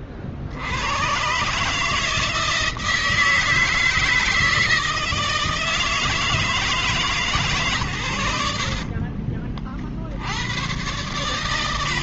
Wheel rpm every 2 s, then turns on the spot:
70, 160, 160, 150, 70, 100.
8-10